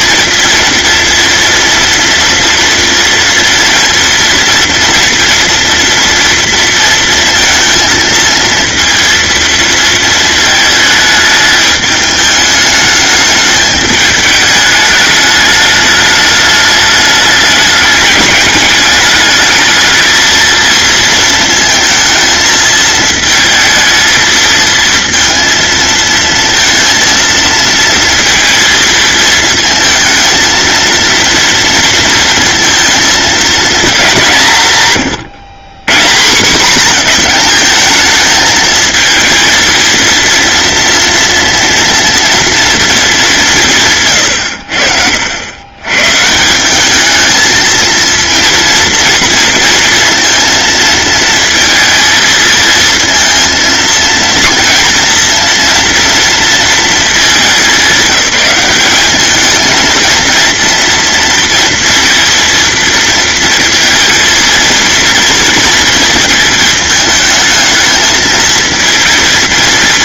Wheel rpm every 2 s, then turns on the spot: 230, 230, 230, 230, 230, 220, 210, 210, 210, 210, 230, 220, 230, 230, 220, 230, 230, 130, 180, 220, 240, 220, 70, 200, 230, 230, 230, 230, 220, 210, 240, 230, 230, 220, 230.
none